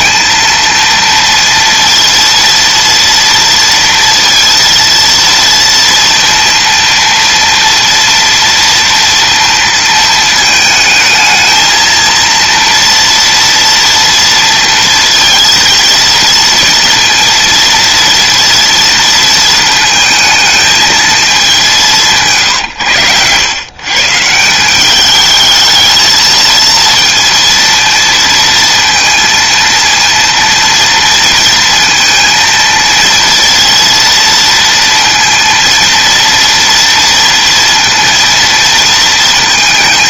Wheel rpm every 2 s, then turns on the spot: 230, 230, 230, 230, 230, 220, 230, 230, 230, 230, 220, 100, 210, 230, 230, 230, 230, 230, 230, 230.
none